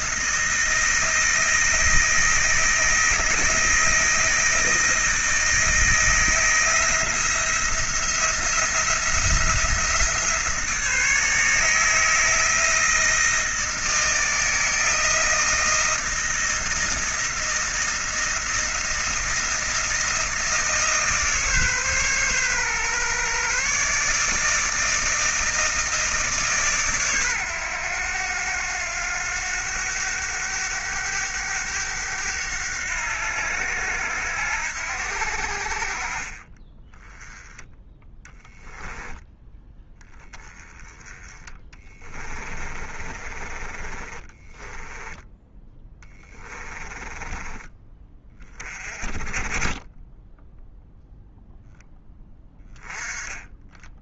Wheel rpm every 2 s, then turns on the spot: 160, 160, 160, 170, 170, 160, 160, 160, 160, 160, 150, 130, 160, 130, 90, 100, 90, 70, 10, 10, 10, 30, 10, 20, 20, 0, 10.
38-40 42-48